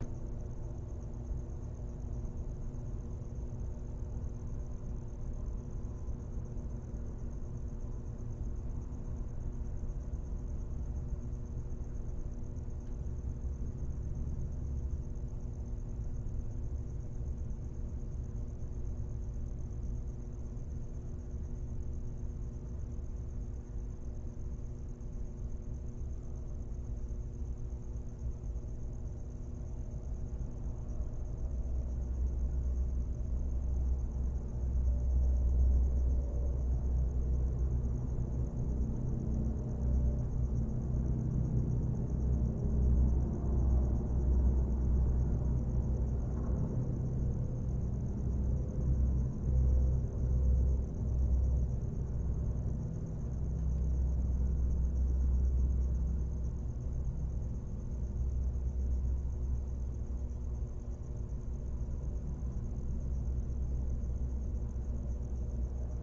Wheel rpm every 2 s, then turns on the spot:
0, 0, 0, 0, 0, 0, 0, 0, 0, 0, 0, 0, 0, 0, 0, 0, 0, 0, 0, 0, 0, 0, 0, 0, 0, 0, 0, 0, 0, 0, 0, 0, 0.
none